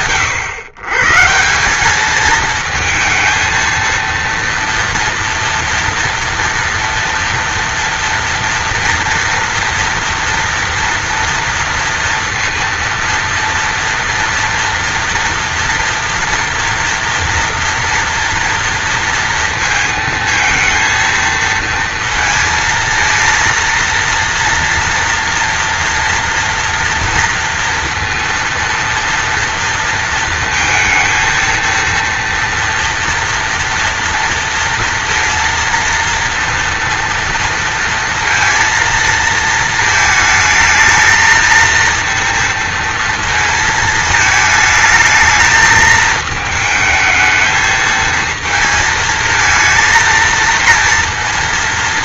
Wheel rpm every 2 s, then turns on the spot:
140, 220, 230, 230, 230, 230, 230, 230, 230, 230, 220, 230, 240, 230, 230, 230, 230, 230, 230, 230, 220, 230, 220, 220, 230, 230.
none